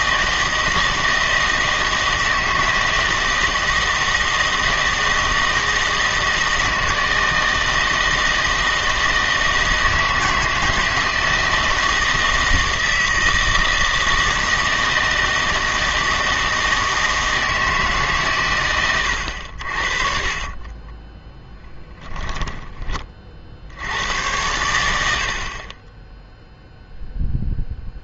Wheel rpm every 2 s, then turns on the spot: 160, 160, 160, 160, 160, 160, 160, 160, 160, 110, 30, 30, 80, 0.
20-24